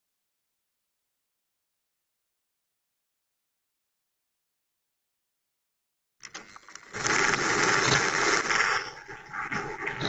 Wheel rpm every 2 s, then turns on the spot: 0, 0, 0, 10, 20.
8-10